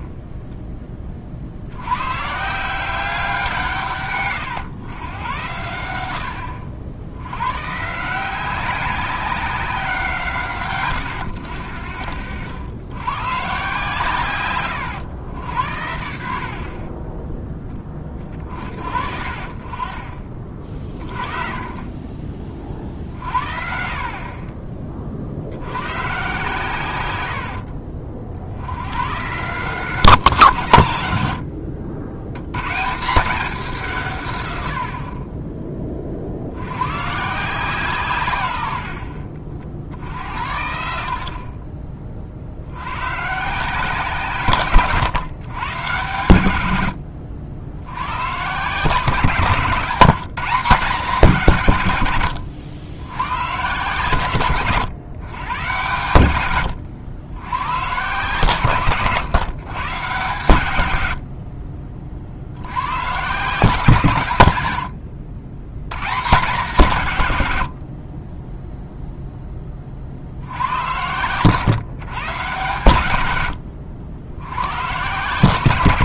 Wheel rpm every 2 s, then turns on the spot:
10, 180, 110, 80, 190, 110, 100, 110, 30, 40, 40, 40, 30, 110, 90, 110, 140, 70, 100, 80, 70, 90, 140, 100, 150, 170, 80, 120, 100, 130, 100, 100, 90, 150, 0, 80, 120, 110.
none